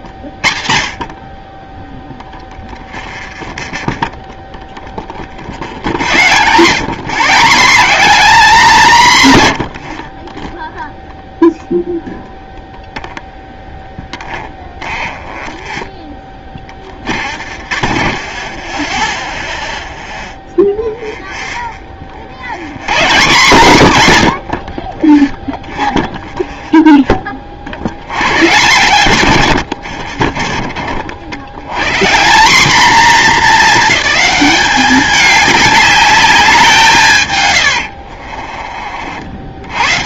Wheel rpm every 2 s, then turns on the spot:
40, 10, 10, 150, 180, 10, 0, 10, 30, 20, 0, 100, 50, 0, 120, 60, 220, 200, 170, 50.
2-4 14-20